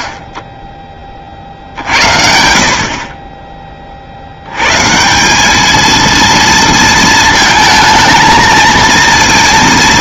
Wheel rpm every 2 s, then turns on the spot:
30, 60, 120, 230, 230.
none